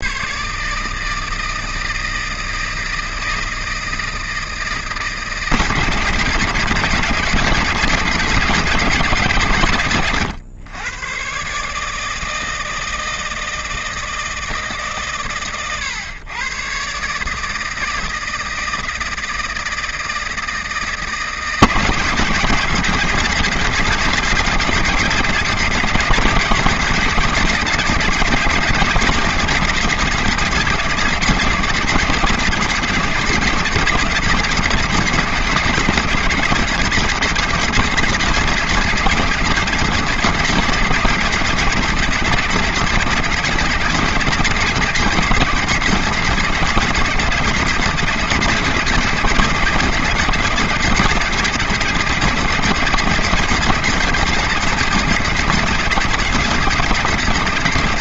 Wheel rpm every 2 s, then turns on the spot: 140, 160, 160, 160, 160, 120, 160, 160, 130, 160, 160, 150, 160, 160, 140, 170, 160, 140, 150, 130, 140, 150, 150, 140, 150, 150, 150, 180, 160.
none